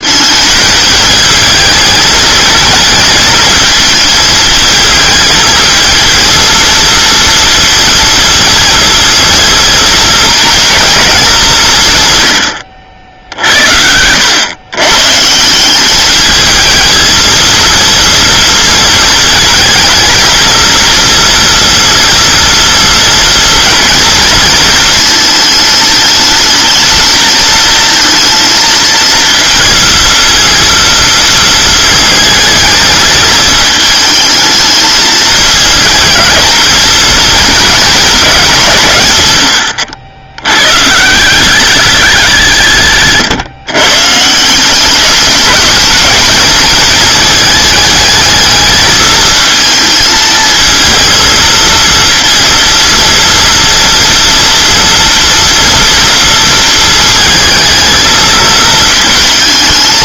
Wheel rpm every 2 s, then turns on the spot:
220, 220, 220, 230, 230, 230, 90, 130, 220, 230, 230, 240, 230, 220, 230, 230, 220, 220, 220, 160, 120, 150, 180, 220, 220, 230, 230, 230, 220, 220.
none